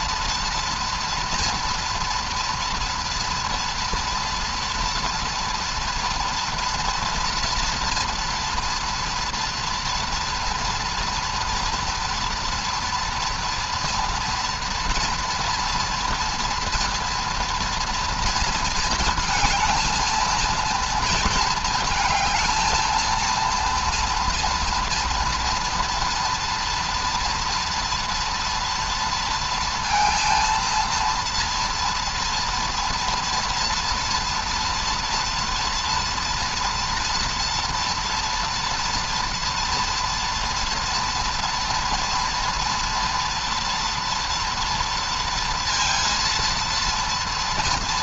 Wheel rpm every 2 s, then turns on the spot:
240, 240, 240, 230, 230, 230, 230, 230, 230, 220, 230, 220, 230, 230, 230, 230, 230, 240, 230, 230, 230, 230, 230, 230.
none